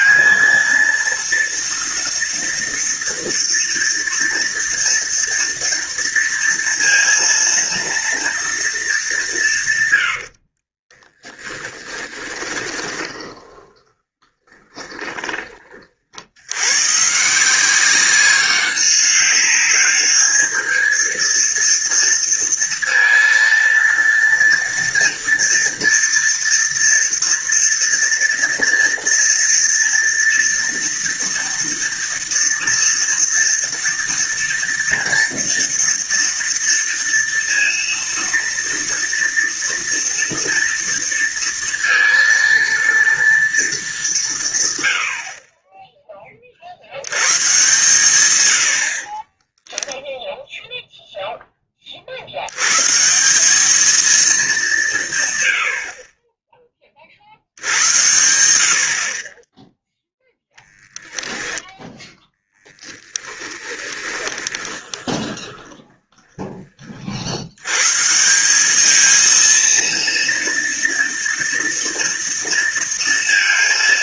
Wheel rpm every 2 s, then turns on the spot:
230, 230, 230, 230, 230, 70, 10, 20, 70, 190, 210, 230, 230, 230, 230, 230, 230, 230, 230, 230, 230, 230, 160, 40, 90, 0, 120, 180, 20, 60, 0, 10, 20, 40, 210, 230, 230.
10-16 62-66